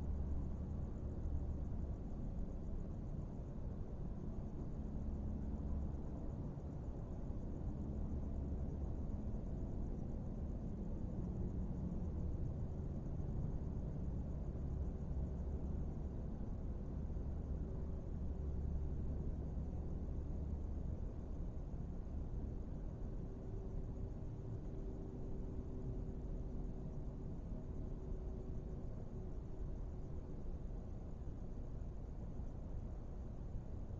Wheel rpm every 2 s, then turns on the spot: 0, 0, 0, 0, 0, 0, 0, 0, 0, 0, 0, 0, 0, 0, 0, 0, 0.
none